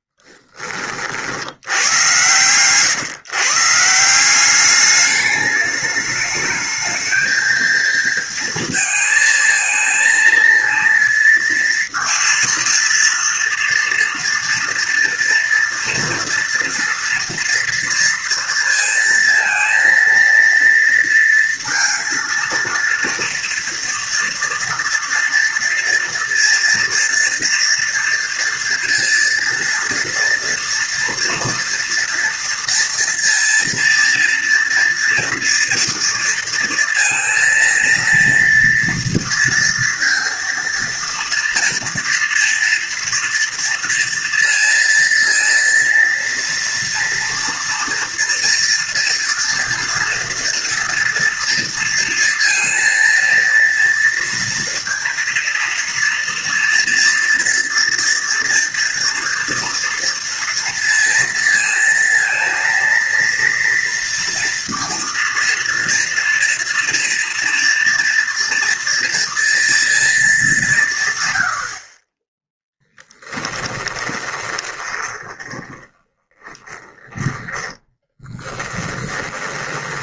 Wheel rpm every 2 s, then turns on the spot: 40, 130, 210, 220, 230, 230, 230, 230, 230, 230, 230, 230, 230, 230, 230, 240, 230, 230, 230, 230, 230, 230, 230, 230, 230, 230, 230, 230, 240, 240, 230, 230, 230, 230, 230, 150, 10, 20, 20, 10.
72-80